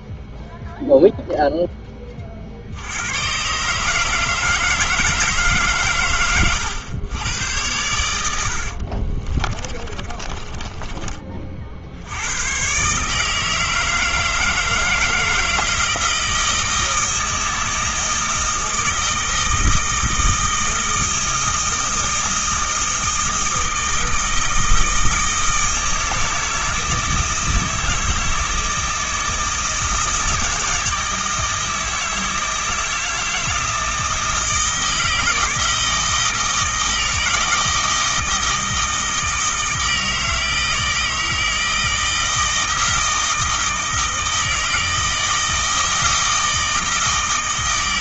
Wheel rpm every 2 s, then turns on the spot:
0, 60, 160, 110, 60, 20, 120, 160, 160, 160, 160, 160, 160, 160, 160, 160, 160, 160, 160, 160, 160, 160, 160, 160.
8-12